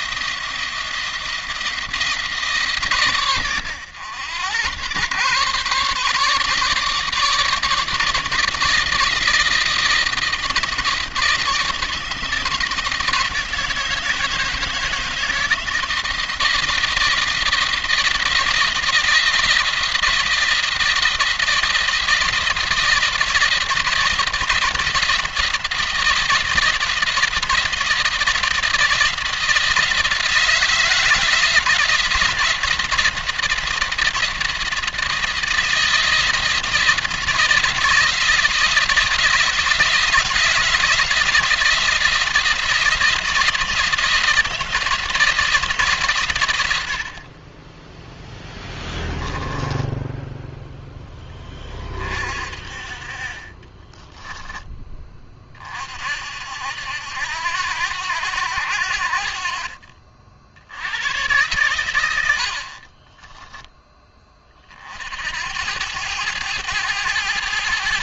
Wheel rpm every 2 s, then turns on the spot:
170, 150, 110, 150, 160, 160, 160, 160, 160, 160, 170, 170, 170, 170, 170, 160, 170, 170, 160, 170, 170, 170, 170, 80, 10, 10, 40, 20, 80, 80, 90, 40, 50, 110.
48-50 62-64